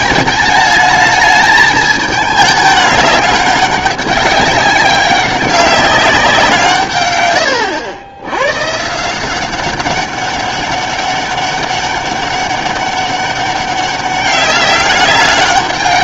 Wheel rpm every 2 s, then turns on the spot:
210, 210, 200, 150, 140, 200, 200, 200.
none